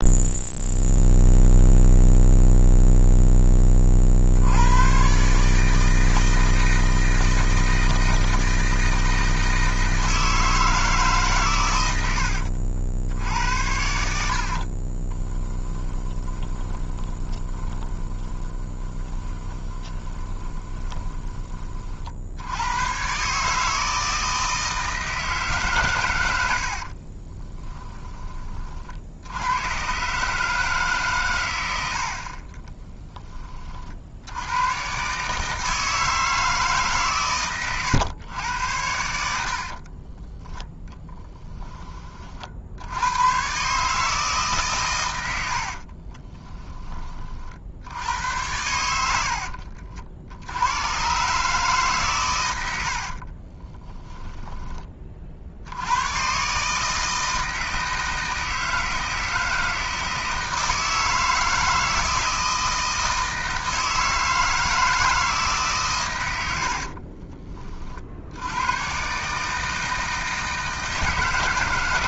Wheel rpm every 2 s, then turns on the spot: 0, 0, 100, 160, 160, 160, 80, 40, 20, 30, 20, 110, 160, 70, 40, 150, 20, 120, 150, 90, 10, 60, 130, 20, 90, 110, 80, 20, 150, 160, 160, 160, 160, 70, 110, 160.
14-22 26-28 32-34 66-68